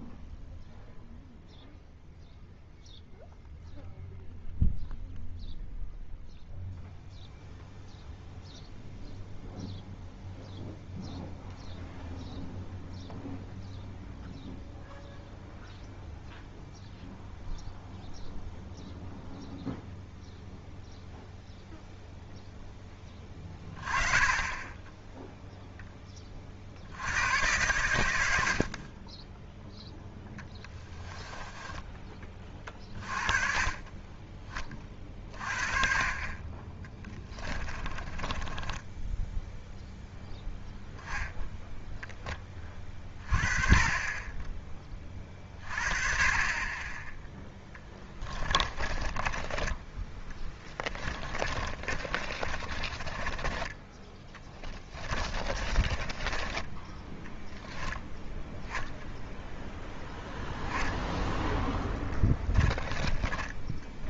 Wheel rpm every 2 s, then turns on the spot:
0, 0, 0, 0, 0, 0, 0, 0, 0, 0, 0, 0, 20, 50, 70, 10, 30, 20, 20, 20, 0, 20, 20, 20, 20, 10, 30, 10, 20, 0, 0, 20.
30-32 38-40 48-58